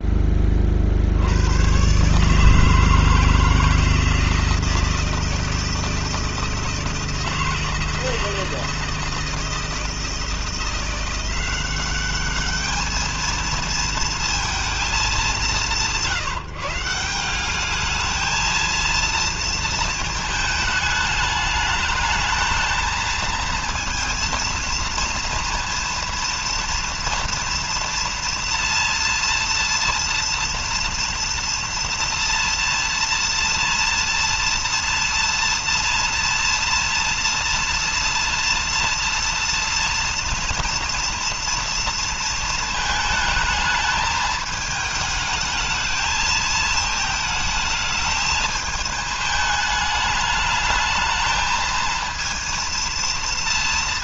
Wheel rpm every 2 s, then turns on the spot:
70, 160, 160, 160, 160, 170, 220, 190, 180, 230, 220, 230, 230, 230, 230, 230, 230, 240, 230, 230, 230, 220, 220, 220, 220, 220, 230.
none